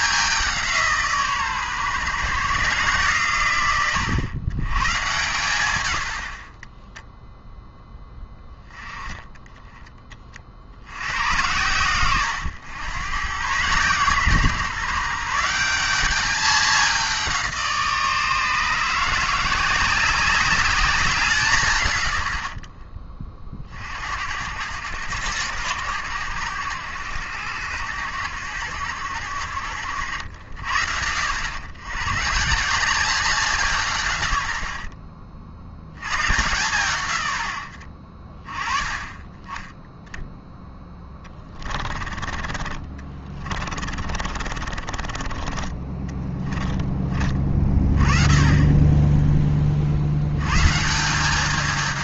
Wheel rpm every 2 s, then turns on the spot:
180, 140, 110, 30, 20, 60, 110, 140, 200, 160, 190, 70, 80, 90, 90, 70, 160, 80, 120, 20, 10, 20, 60, 20, 20, 130.
44-48